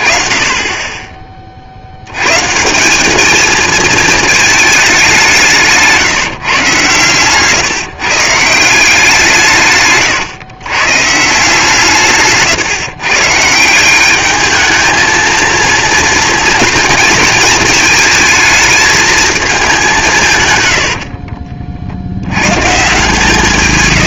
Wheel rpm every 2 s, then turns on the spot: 20, 150, 210, 140, 170, 130, 140, 220, 230, 220, 100, 130.
none